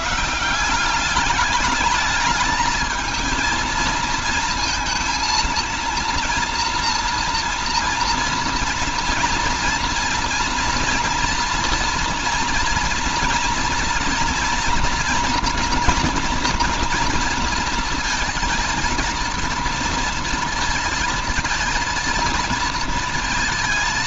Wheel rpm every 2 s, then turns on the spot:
180, 210, 230, 230, 230, 240, 230, 240, 230, 220, 230, 230.
none